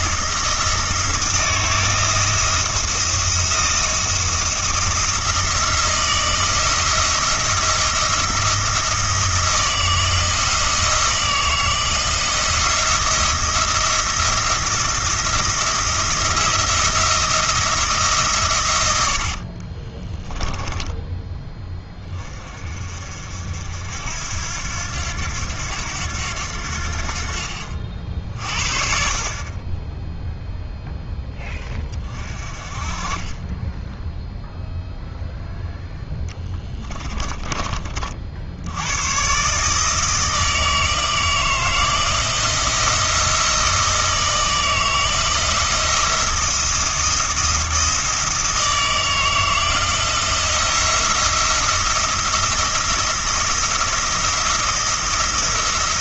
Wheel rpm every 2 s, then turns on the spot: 170, 170, 170, 170, 170, 160, 170, 170, 170, 100, 10, 40, 90, 80, 40, 0, 40, 0, 30, 90, 160, 170, 160, 170, 160, 170, 170, 170.
20-22 36-38